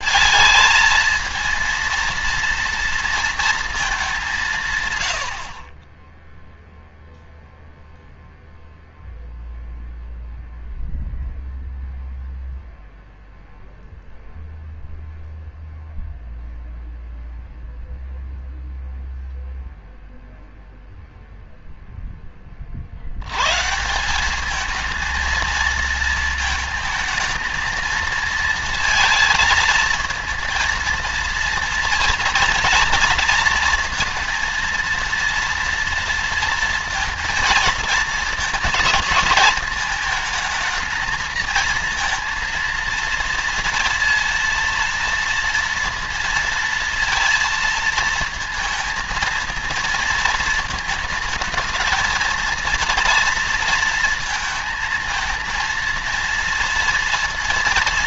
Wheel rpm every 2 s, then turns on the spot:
230, 230, 160, 0, 0, 0, 0, 0, 0, 0, 0, 30, 200, 220, 230, 230, 230, 230, 230, 230, 220, 230, 230, 230, 230, 220, 230, 230, 230.
none